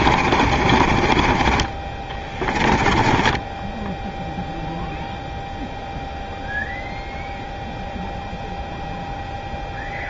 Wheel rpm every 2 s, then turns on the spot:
40, 20, 0, 0, 0.
0-4